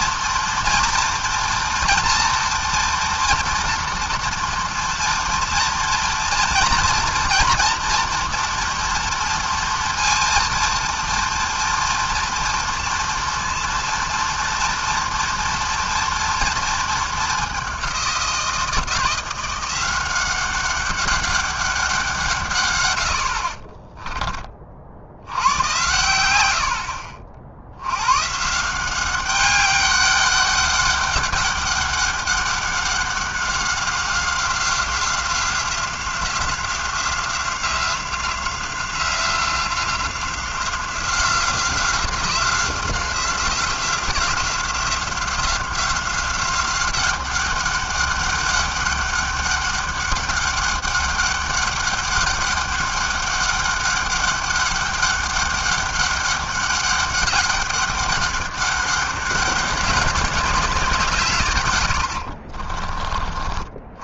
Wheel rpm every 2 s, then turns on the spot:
230, 230, 230, 230, 240, 230, 230, 230, 230, 170, 190, 130, 20, 100, 150, 200, 200, 190, 180, 180, 180, 180, 180, 190, 200, 200, 200, 200, 200, 200, 200, 50.
62-64